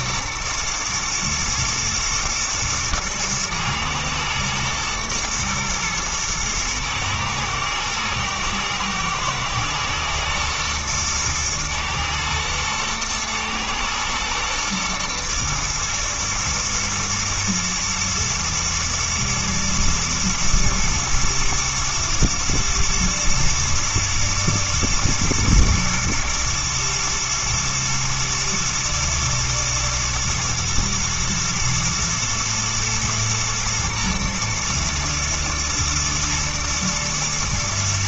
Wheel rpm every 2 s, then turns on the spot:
110, 110, 120, 120, 110, 120, 110, 110, 110, 110, 120, 110, 110, 110, 120, 120, 120, 110, 110.
none